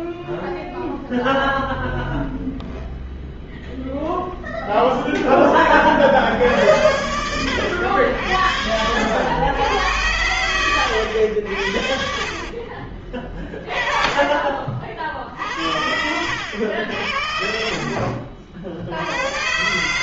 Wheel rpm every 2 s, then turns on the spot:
0, 0, 40, 80, 100, 70, 30, 60, 60, 80.
12-14 18-20